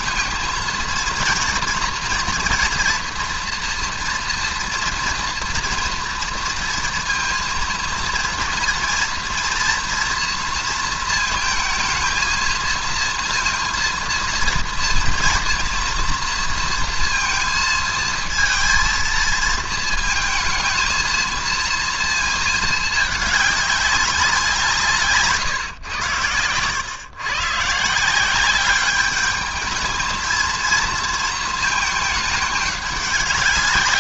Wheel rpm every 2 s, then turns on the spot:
230, 230, 230, 230, 230, 230, 220, 230, 230, 230, 230, 220, 180, 110, 190, 230, 210.
none